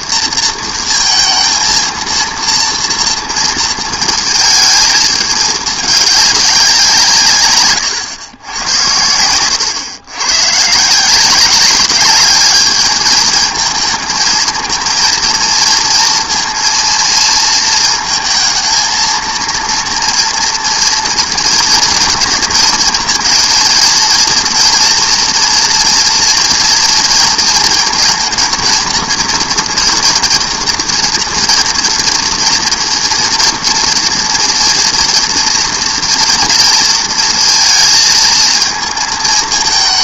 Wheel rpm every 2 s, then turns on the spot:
230, 230, 220, 200, 90, 140, 210, 230, 230, 220, 230, 220, 230, 240, 230, 230, 230, 230, 230, 220.
none